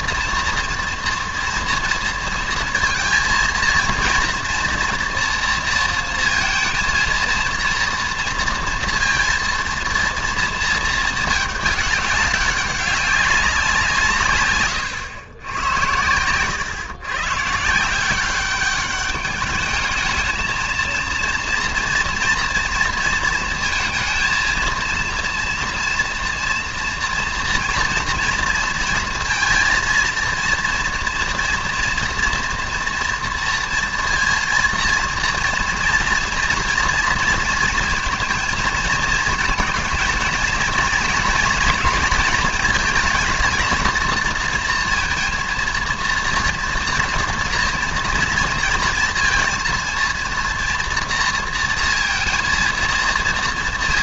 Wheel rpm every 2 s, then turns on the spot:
230, 230, 240, 230, 230, 230, 200, 130, 120, 200, 220, 230, 230, 230, 230, 230, 230, 230, 230, 230, 220, 220, 230, 230, 230, 230, 230.
none